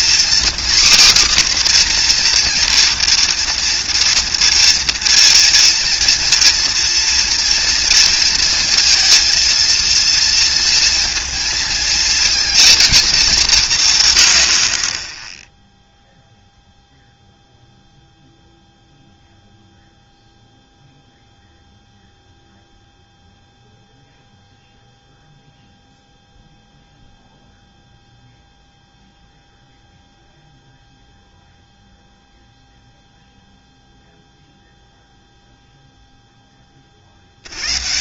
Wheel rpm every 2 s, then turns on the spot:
270, 240, 230, 240, 230, 230, 230, 50, 0, 0, 0, 0, 0, 0, 0, 0, 0, 0, 30.
none